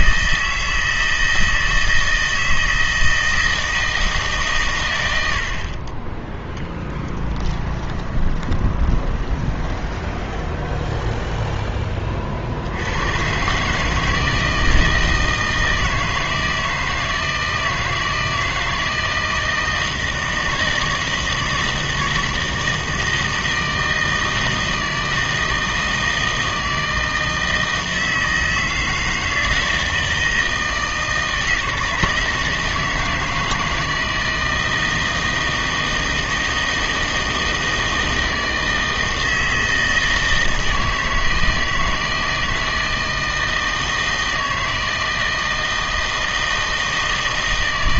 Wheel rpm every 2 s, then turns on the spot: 160, 160, 110, 10, 20, 10, 80, 160, 160, 160, 160, 160, 160, 160, 160, 160, 160, 160, 160, 160, 160, 160, 160, 160.
6-12